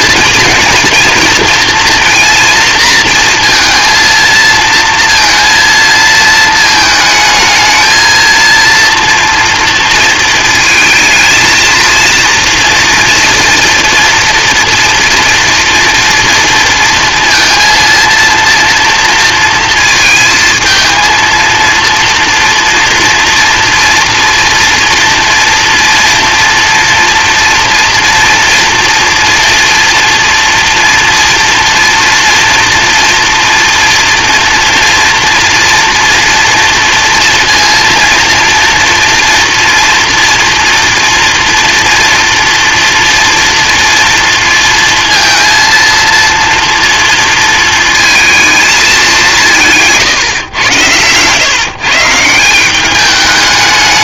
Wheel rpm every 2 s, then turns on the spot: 230, 230, 230, 220, 230, 220, 230, 230, 230, 230, 230, 240, 230, 230, 230, 230, 230, 230, 230, 230, 230, 240, 230, 230, 200, 120, 200.
50-52